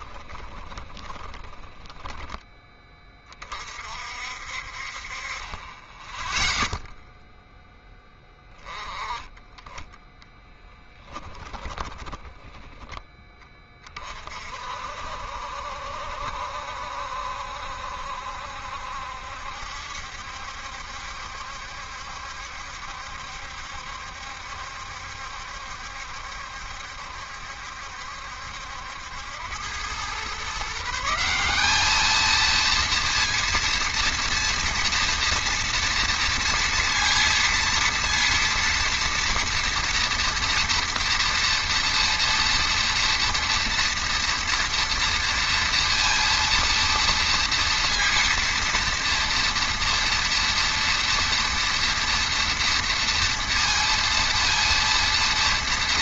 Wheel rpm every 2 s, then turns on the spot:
20, 20, 50, 10, 20, 10, 10, 40, 70, 70, 70, 70, 70, 70, 70, 140, 220, 230, 230, 230, 230, 230, 230, 230, 240, 240, 230, 230.
0-2 12-14